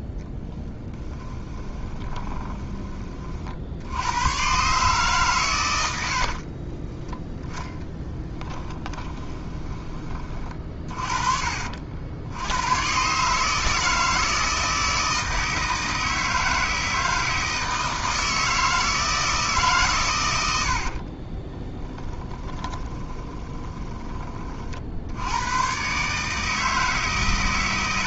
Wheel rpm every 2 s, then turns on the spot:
10, 20, 140, 20, 20, 40, 120, 160, 160, 160, 60, 20, 60, 150.
0-2 6-10 20-24